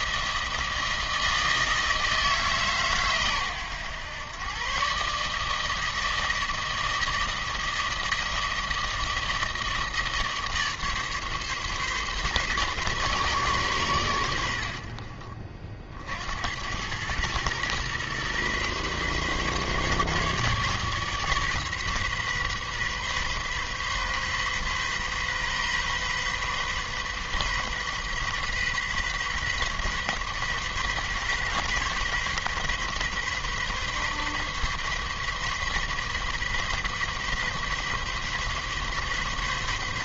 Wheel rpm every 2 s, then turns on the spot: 160, 130, 140, 160, 160, 150, 140, 60, 100, 130, 140, 130, 130, 130, 130, 130, 130, 130, 130, 140.
none